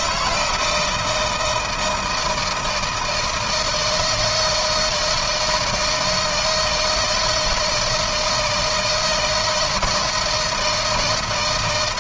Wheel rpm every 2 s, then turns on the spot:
160, 160, 160, 160, 160, 170.
none